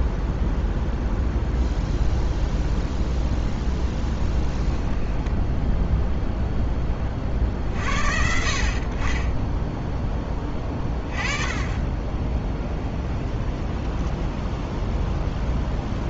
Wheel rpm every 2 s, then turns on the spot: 0, 0, 10, 10, 50, 20, 20, 10.
4-6 12-16